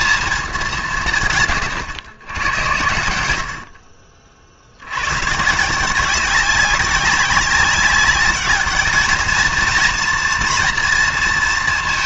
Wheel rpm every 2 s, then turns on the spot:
190, 100, 70, 190, 220, 230.
none